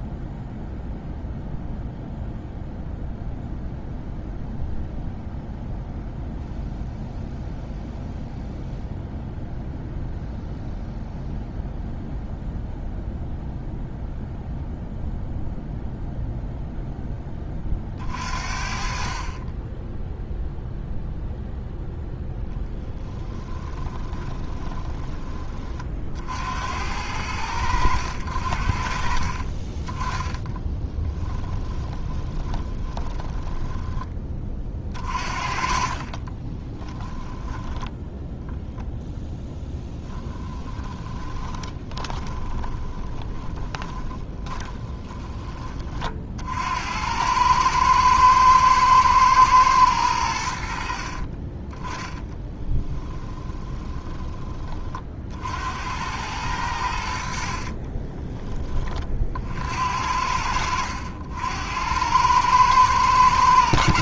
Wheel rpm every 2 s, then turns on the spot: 0, 0, 0, 0, 0, 0, 0, 0, 0, 50, 0, 10, 20, 70, 60, 10, 20, 30, 30, 0, 20, 20, 20, 70, 120, 70, 10, 30, 90, 20, 70, 110.
22-26 30-34 36-38 40-46 52-54